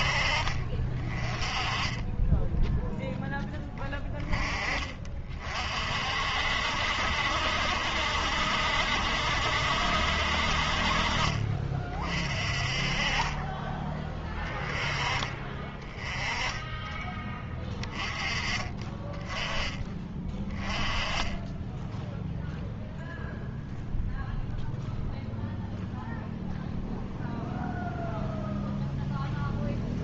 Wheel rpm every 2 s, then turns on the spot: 40, 10, 20, 60, 70, 50, 40, 10, 20, 20, 20, 0, 0, 0, 0.
20-22